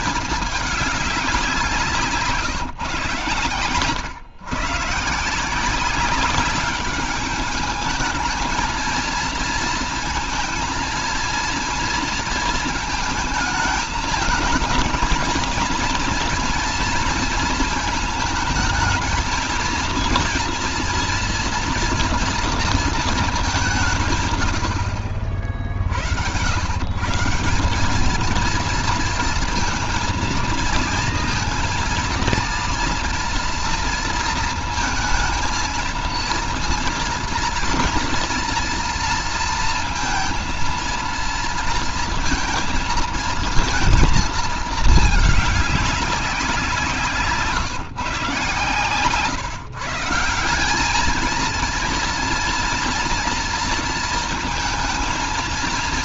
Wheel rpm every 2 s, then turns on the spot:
200, 130, 150, 200, 220, 230, 220, 220, 230, 220, 240, 230, 80, 140, 230, 230, 230, 220, 230, 230, 230, 230, 220, 180, 130, 200, 230, 230.
none